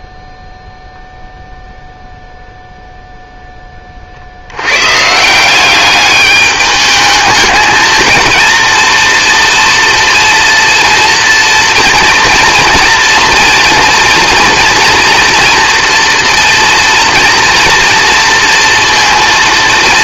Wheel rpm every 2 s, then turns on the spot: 0, 0, 90, 210, 230, 230, 230, 240, 230, 230.
none